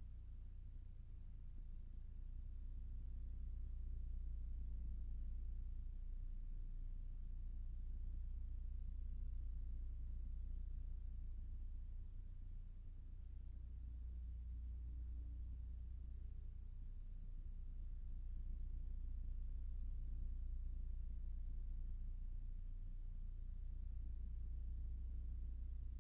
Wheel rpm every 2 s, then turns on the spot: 0, 0, 0, 0, 0, 0, 0, 0, 0, 0, 0, 0, 0.
none